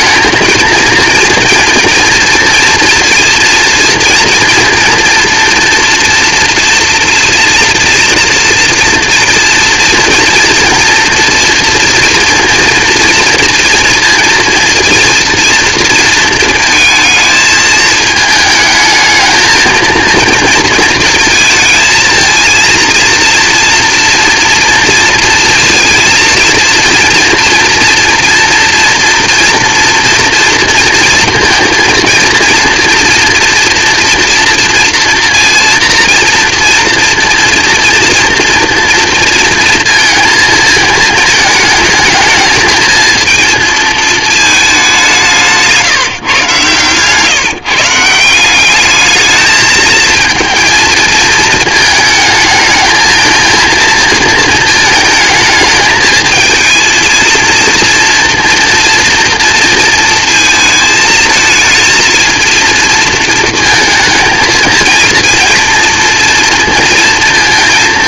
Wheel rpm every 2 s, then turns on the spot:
220, 230, 230, 230, 230, 230, 230, 230, 230, 220, 230, 230, 230, 230, 230, 230, 230, 230, 230, 230, 230, 220, 220, 130, 180, 230, 220, 230, 220, 230, 220, 230, 220, 230.
none